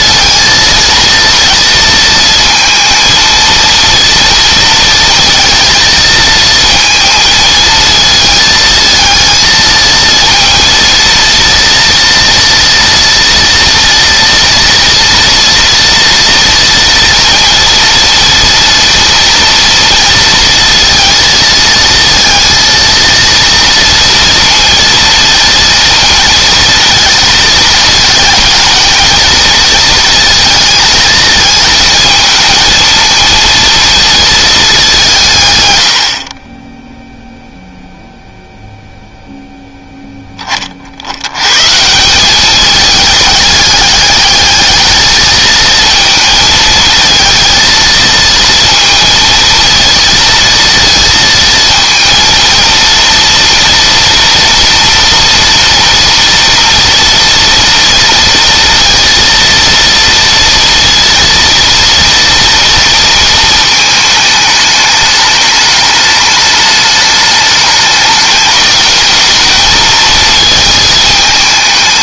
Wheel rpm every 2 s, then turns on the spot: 230, 230, 230, 230, 220, 230, 230, 230, 230, 230, 230, 230, 230, 230, 230, 220, 220, 200, 10, 0, 50, 210, 210, 220, 230, 230, 230, 240, 230, 230, 230, 230, 210, 210, 210, 220.
none